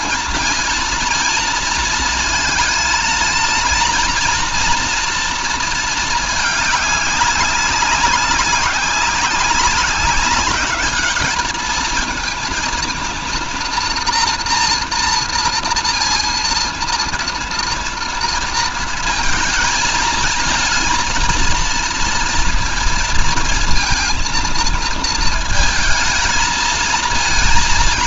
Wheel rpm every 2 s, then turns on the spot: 230, 230, 230, 190, 190, 210, 230, 240, 230, 220, 220, 230, 230, 230.
none